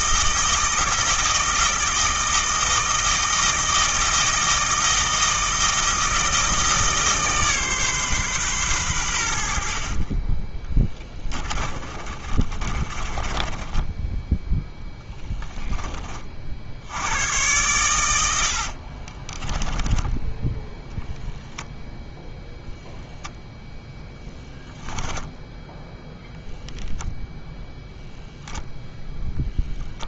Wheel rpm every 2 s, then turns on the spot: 160, 160, 160, 160, 120, 10, 30, 0, 80, 50, 0, 0, 10, 0, 0.
10-14 18-20